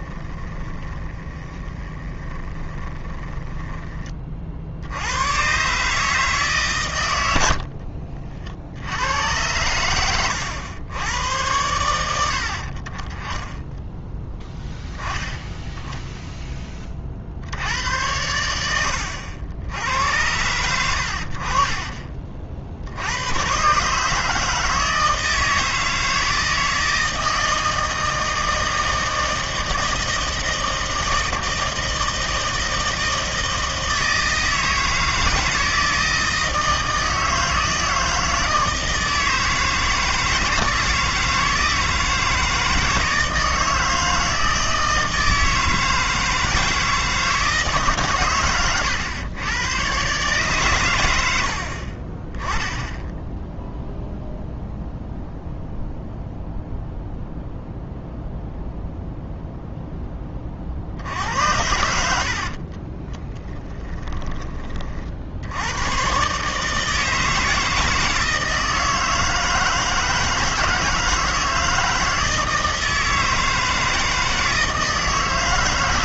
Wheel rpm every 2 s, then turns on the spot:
20, 20, 60, 130, 70, 100, 50, 0, 30, 90, 90, 60, 160, 160, 160, 160, 160, 160, 160, 160, 160, 160, 160, 160, 120, 130, 10, 0, 0, 0, 50, 30, 30, 160, 160, 160, 160, 160.
0-4 62-64